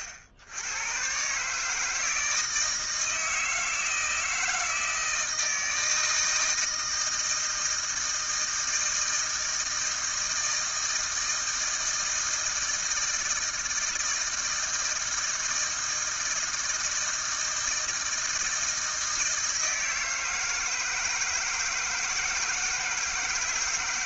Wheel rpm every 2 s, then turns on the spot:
90, 160, 160, 160, 160, 160, 160, 160, 160, 160, 160, 160.
none